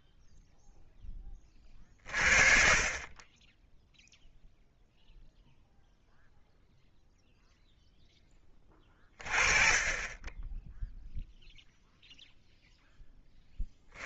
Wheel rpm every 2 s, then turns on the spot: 30, 0, 0, 20, 0, 10, 20.
none